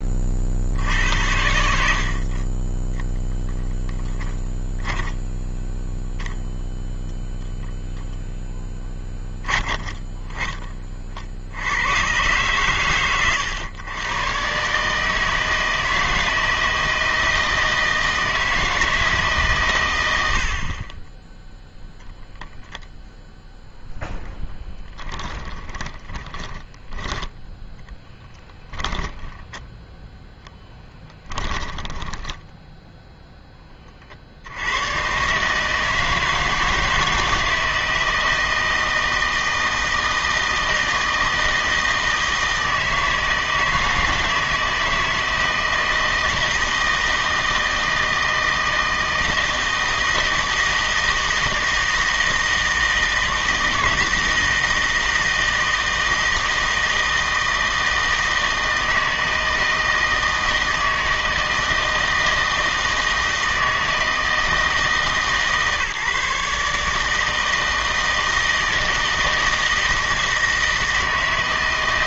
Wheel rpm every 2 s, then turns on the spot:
70, 20, 10, 0, 10, 30, 120, 140, 160, 160, 30, 0, 10, 20, 20, 10, 0, 90, 160, 160, 160, 160, 160, 160, 160, 160, 160, 160, 160, 160, 160, 160, 150, 150, 160, 160.
4-6 20-22 24-32